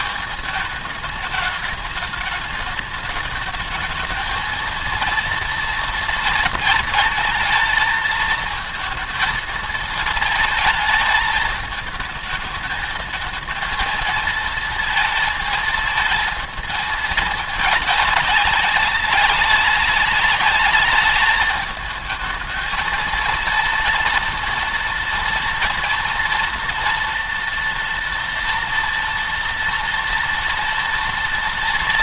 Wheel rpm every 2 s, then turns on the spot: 210, 210, 230, 230, 220, 220, 220, 230, 220, 200, 210, 220, 230, 230, 230, 230.
none